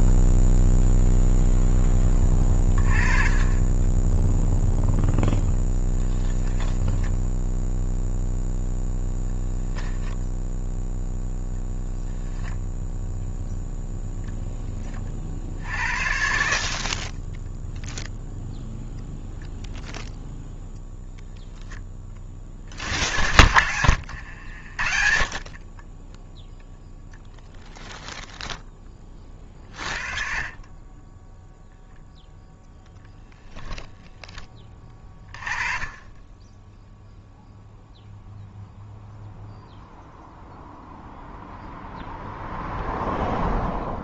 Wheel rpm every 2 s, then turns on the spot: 0, 30, 0, 10, 0, 0, 0, 20, 50, 0, 0, 50, 70, 0, 10, 30, 0, 20, 10, 0, 0, 0.
none